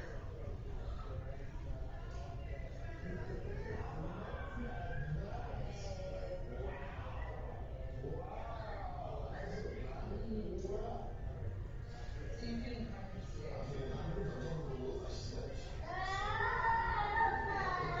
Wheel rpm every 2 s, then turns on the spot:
0, 0, 0, 0, 0, 0, 0, 0, 0.
none